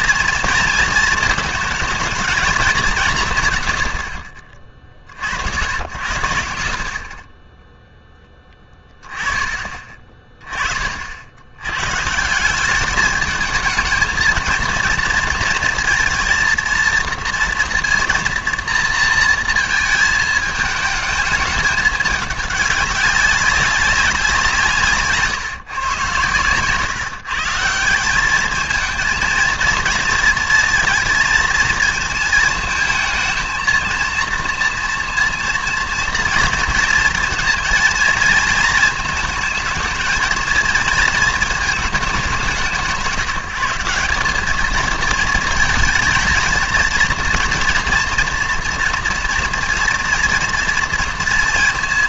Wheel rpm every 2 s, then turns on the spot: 230, 210, 50, 60, 20, 30, 200, 230, 230, 230, 220, 200, 160, 120, 220, 230, 220, 230, 230, 230, 230, 170, 210, 230, 230, 230.
none